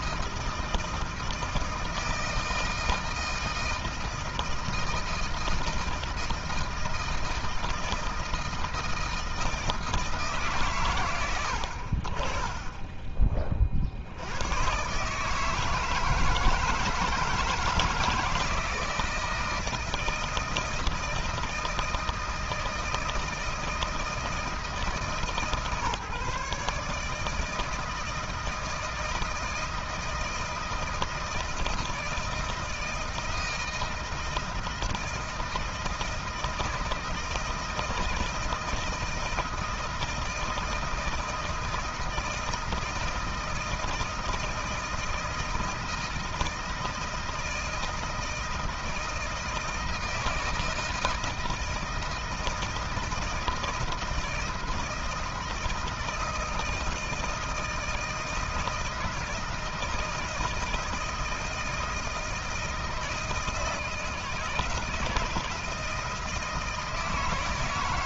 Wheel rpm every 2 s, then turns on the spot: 160, 160, 160, 160, 160, 150, 50, 80, 160, 170, 160, 160, 160, 140, 160, 160, 160, 160, 160, 160, 160, 160, 160, 160, 160, 160, 160, 160, 160, 160, 160, 160, 160, 160.
none